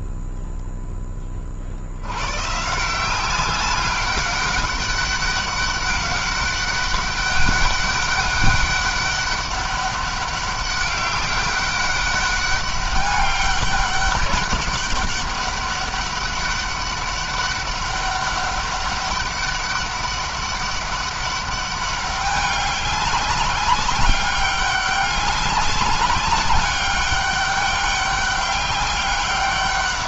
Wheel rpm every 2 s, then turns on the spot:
10, 170, 200, 200, 200, 200, 200, 200, 200, 200, 200, 200, 200, 200, 200.
none